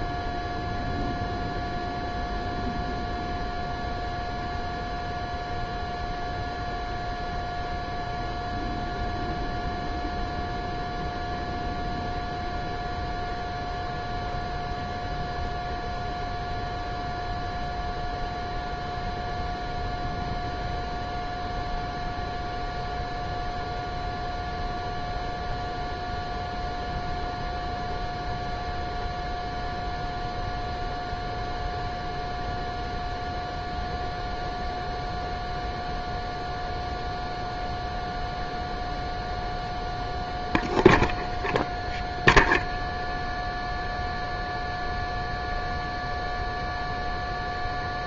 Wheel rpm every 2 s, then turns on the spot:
0, 0, 0, 0, 0, 0, 0, 0, 0, 0, 0, 0, 0, 0, 0, 0, 0, 0, 0, 0, 0, 0, 0, 0.
none